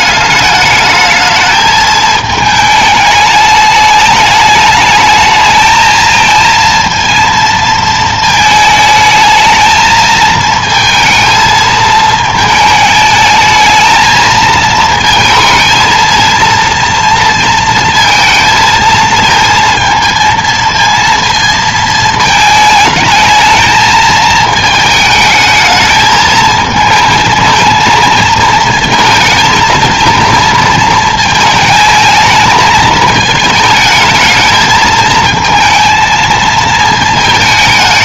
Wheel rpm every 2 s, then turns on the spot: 210, 220, 210, 230, 220, 220, 220, 220, 230, 230, 230, 220, 220, 220, 220, 220, 220, 220, 220.
none